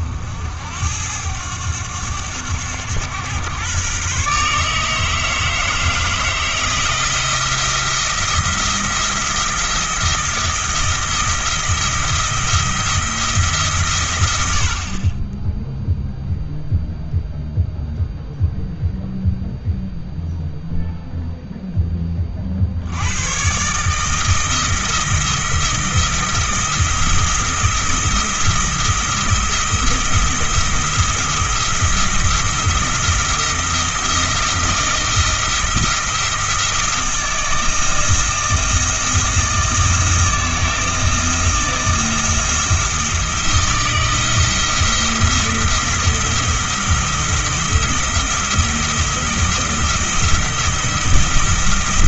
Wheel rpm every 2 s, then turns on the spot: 80, 100, 150, 160, 170, 170, 170, 60, 0, 0, 0, 70, 170, 170, 170, 170, 170, 170, 170, 170, 160, 170, 170, 170, 170, 170.
none